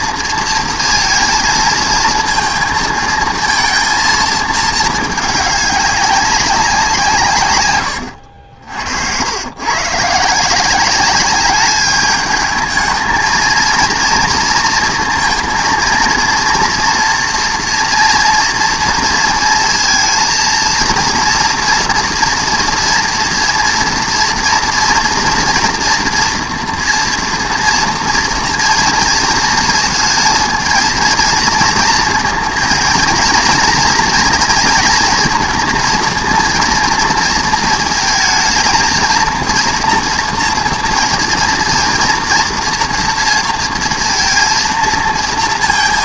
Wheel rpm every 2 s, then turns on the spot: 230, 230, 220, 170, 80, 200, 220, 230, 230, 230, 230, 230, 230, 230, 230, 230, 240, 230, 230, 230, 230, 240, 230.
none